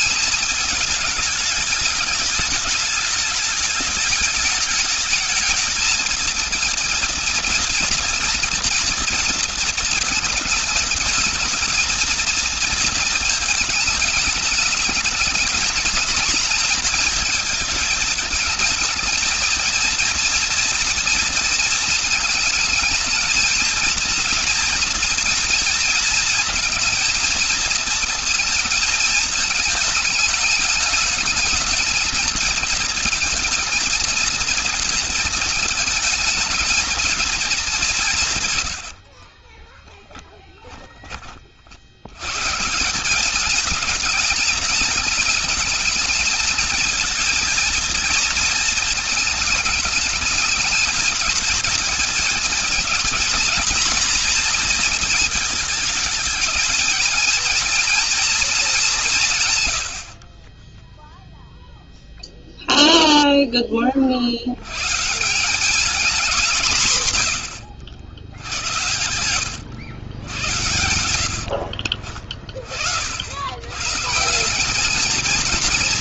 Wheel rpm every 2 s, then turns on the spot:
220, 210, 210, 230, 230, 220, 230, 210, 220, 220, 230, 220, 230, 230, 220, 220, 230, 230, 220, 100, 20, 170, 210, 230, 220, 210, 230, 230, 220, 190, 10, 0, 120, 150, 90, 100, 50, 210.
38-40